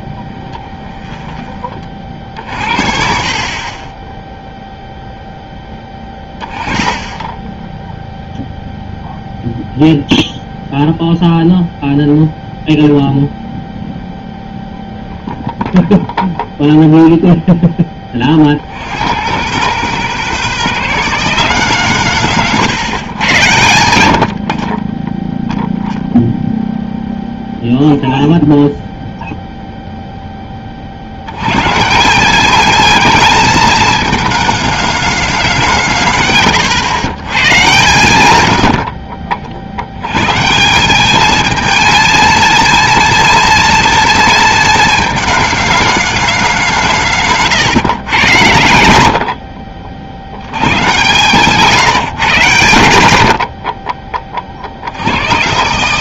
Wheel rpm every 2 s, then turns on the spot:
10, 50, 0, 10, 0, 0, 0, 0, 0, 70, 170, 140, 30, 0, 0, 20, 210, 220, 110, 90, 150, 230, 230, 180, 100, 120, 120, 50.
0-2 22-24